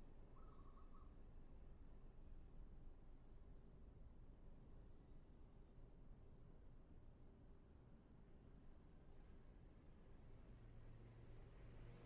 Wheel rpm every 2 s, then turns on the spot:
0, 0, 0, 0, 0, 0.
none